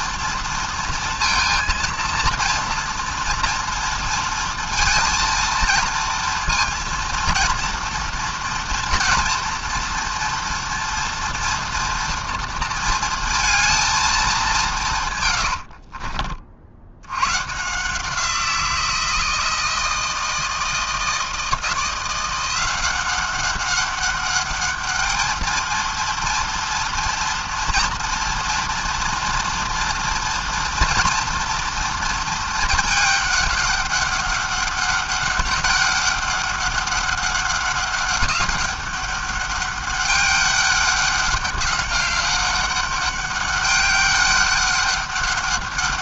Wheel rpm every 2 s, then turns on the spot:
230, 230, 230, 230, 230, 230, 230, 160, 70, 170, 160, 180, 210, 230, 230, 230, 220, 200, 200, 200, 200, 200, 200.
none